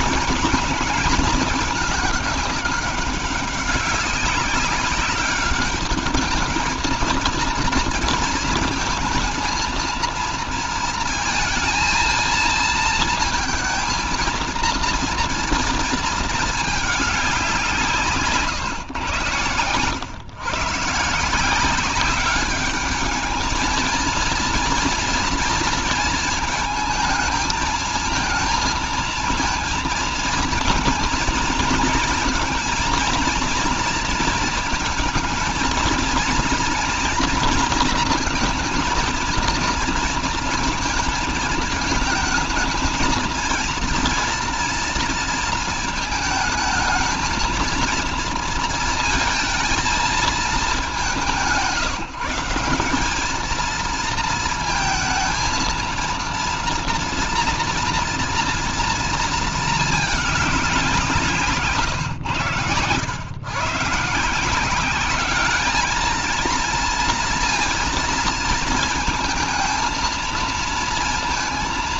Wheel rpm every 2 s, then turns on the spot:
220, 200, 190, 220, 220, 230, 230, 230, 210, 110, 140, 210, 230, 220, 230, 220, 230, 220, 230, 230, 230, 230, 230, 220, 230, 190, 200, 220, 230, 230, 180, 110, 190, 230, 230, 230.
none